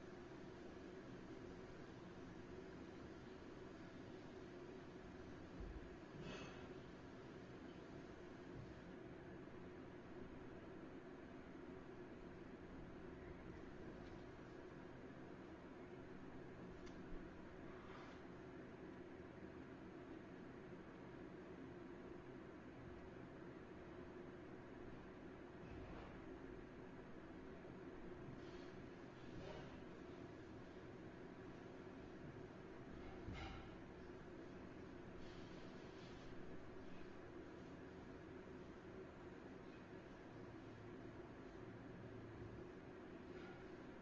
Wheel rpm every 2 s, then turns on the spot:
0, 0, 0, 0, 0, 0, 0, 0, 0, 0, 0, 0, 0, 0, 0, 0, 0, 0, 0, 0, 0, 0.
none